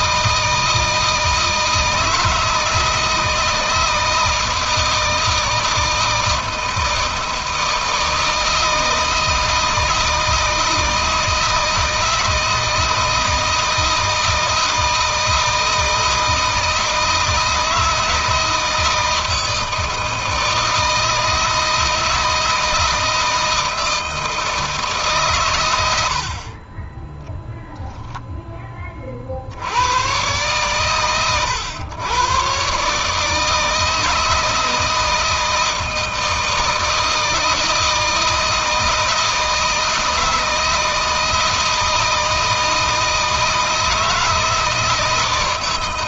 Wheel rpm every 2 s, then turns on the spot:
160, 160, 160, 160, 160, 160, 160, 160, 160, 160, 160, 160, 150, 20, 20, 120, 140, 160, 160, 160, 160, 160, 160.
none